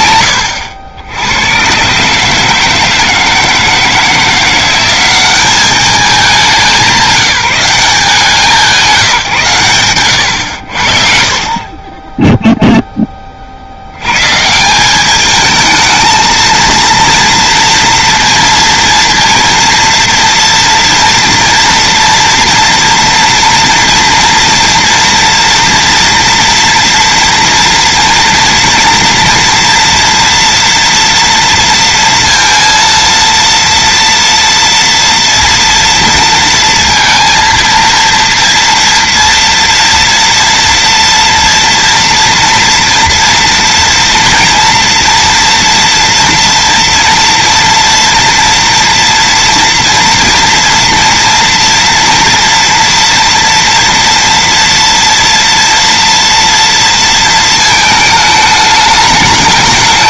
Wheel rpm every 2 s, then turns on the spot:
90, 160, 190, 180, 160, 30, 20, 210, 230, 230, 230, 230, 230, 230, 230, 230, 230, 230, 230, 240, 240, 230, 230, 230, 230, 230, 240, 230, 230, 210.
none